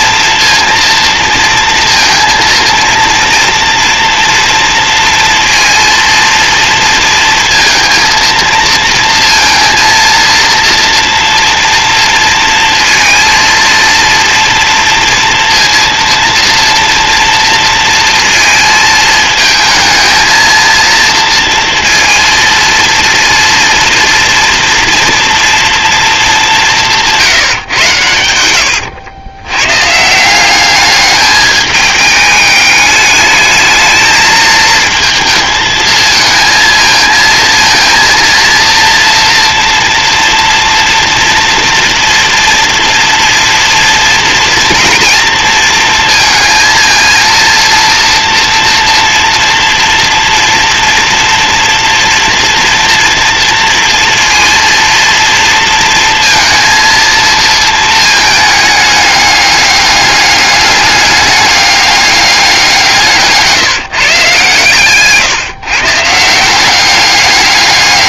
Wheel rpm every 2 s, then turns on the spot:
230, 230, 230, 230, 230, 230, 230, 230, 230, 220, 230, 230, 230, 160, 100, 210, 210, 230, 230, 230, 230, 230, 230, 230, 230, 230, 230, 230, 230, 210, 200, 160, 150, 200.
26-28 62-64